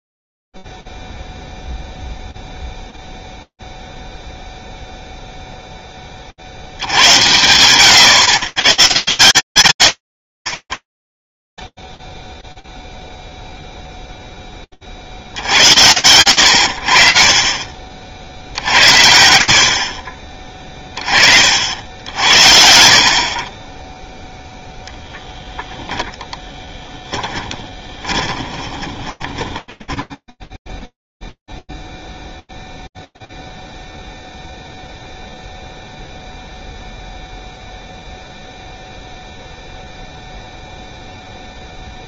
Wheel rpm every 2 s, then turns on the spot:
0, 0, 0, 30, 130, 70, 0, 20, 80, 70, 30, 60, 0, 20, 20, 0, 0, 0, 0, 0, 0.
26-30